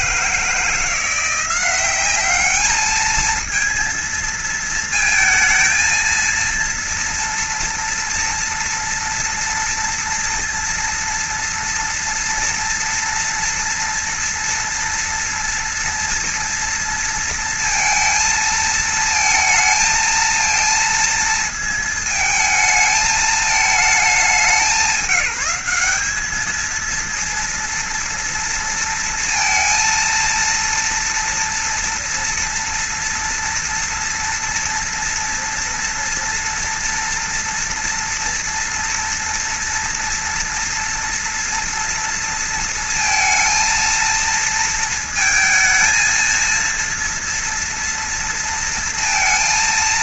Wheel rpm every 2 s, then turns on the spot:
160, 210, 220, 230, 240, 230, 230, 240, 230, 220, 230, 220, 200, 220, 230, 230, 230, 230, 230, 230, 230, 230, 220, 230, 230.
none